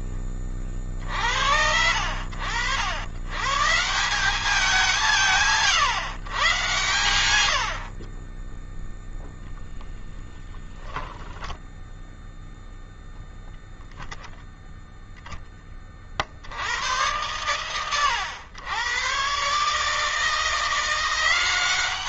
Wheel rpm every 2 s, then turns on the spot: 20, 80, 190, 120, 10, 10, 0, 0, 70, 100, 160.
none